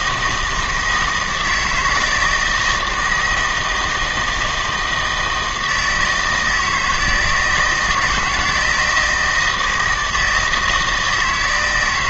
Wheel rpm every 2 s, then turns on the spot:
160, 160, 160, 160, 170, 160.
none